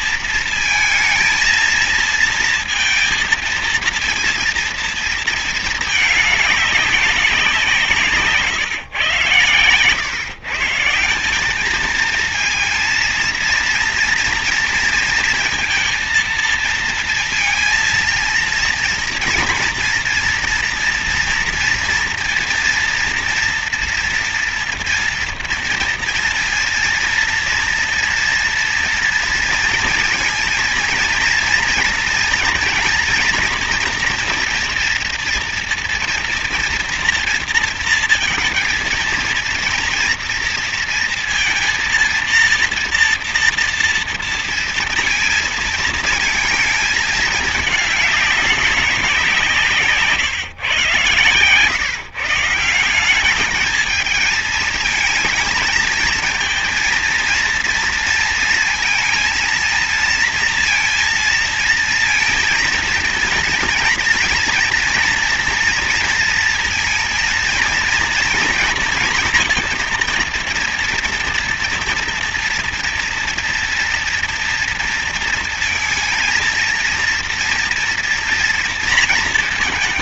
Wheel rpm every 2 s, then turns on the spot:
230, 230, 230, 200, 140, 150, 230, 230, 230, 230, 230, 230, 230, 230, 230, 230, 230, 240, 230, 230, 230, 230, 220, 220, 190, 130, 180, 220, 230, 230, 230, 230, 240, 230, 230, 230, 230, 230, 230, 230.
none